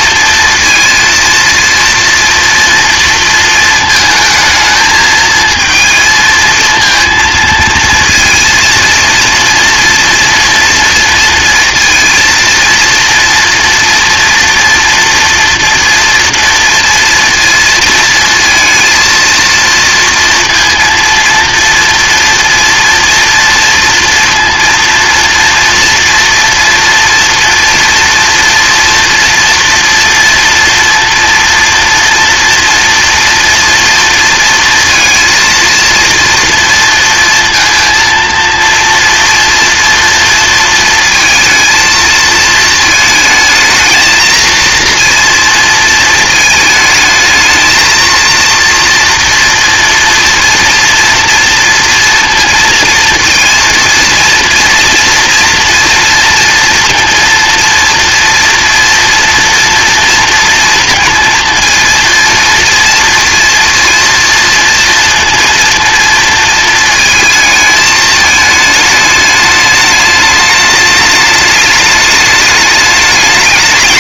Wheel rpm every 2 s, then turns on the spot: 230, 230, 220, 220, 230, 230, 230, 230, 230, 230, 230, 240, 230, 230, 230, 230, 240, 230, 230, 230, 230, 230, 230, 220, 230, 230, 230, 230, 240, 230, 230, 230, 230, 230, 210, 210, 210.
none